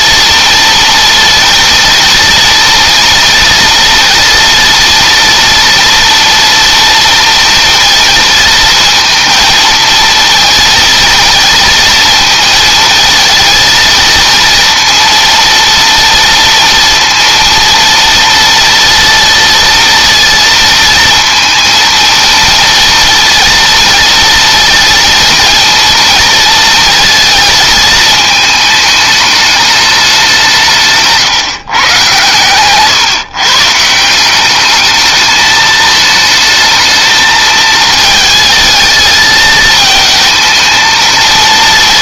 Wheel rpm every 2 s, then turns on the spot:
230, 230, 240, 230, 230, 230, 220, 230, 230, 230, 230, 230, 230, 230, 210, 150, 130, 210, 220, 220, 220.
none